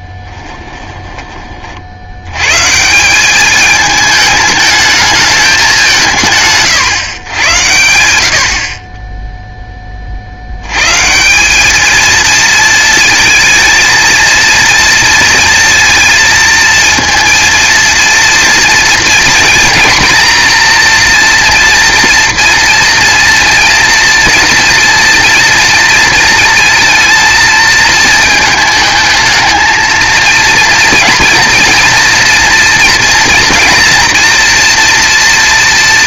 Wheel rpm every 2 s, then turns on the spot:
20, 150, 210, 140, 30, 130, 230, 230, 230, 230, 230, 230, 240, 230, 220, 230, 230, 230.
0-2